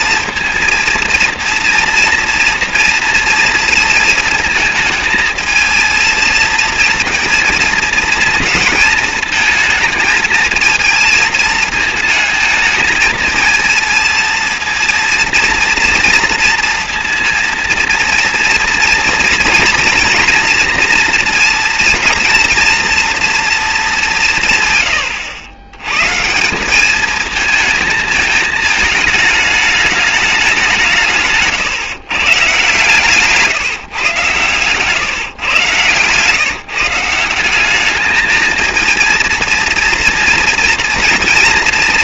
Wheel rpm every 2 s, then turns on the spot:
230, 230, 220, 230, 230, 220, 220, 230, 230, 230, 230, 230, 140, 190, 220, 180, 140, 130, 150, 220, 230.
34-36